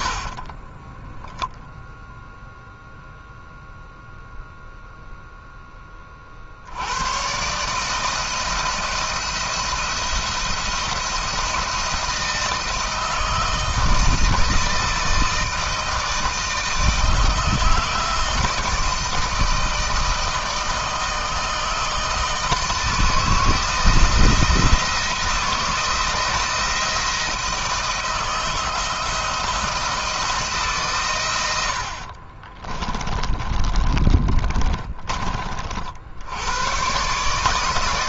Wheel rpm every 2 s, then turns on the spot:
10, 0, 0, 90, 170, 170, 160, 160, 160, 160, 160, 160, 170, 170, 160, 130, 30, 30, 120.
0-2 32-34